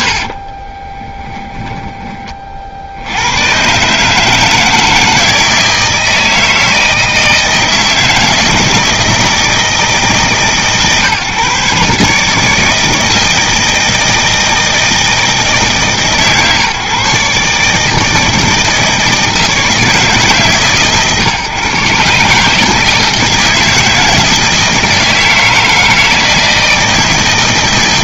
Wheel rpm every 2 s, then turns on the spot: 90, 20, 140, 160, 160, 160, 150, 160, 140, 160, 150, 140, 160, 160.
0-4